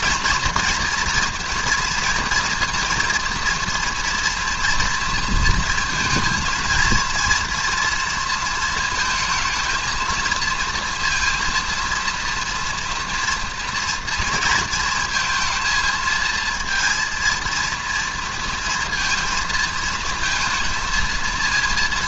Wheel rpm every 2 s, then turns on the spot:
240, 230, 230, 230, 230, 230, 230, 230, 230, 230, 230.
none